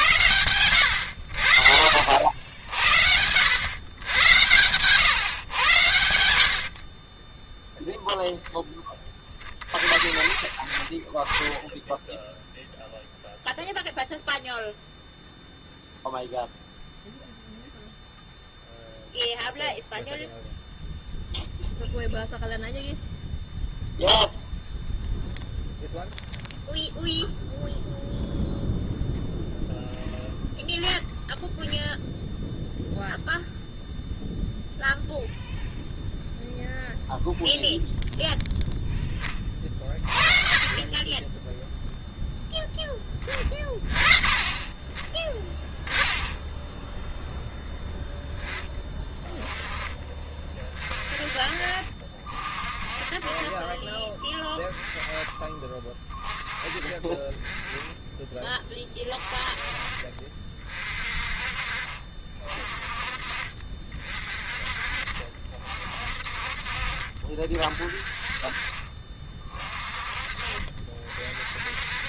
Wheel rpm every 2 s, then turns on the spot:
100, 80, 110, 30, 20, 20, 0, 0, 0, 0, 0, 0, 0, 0, 0, 0, 0, 0, 0, 10, 20, 10, 30, 0, 10, 30, 30, 20, 20, 30, 40, 40, 40, 40, 30, 40.
6-8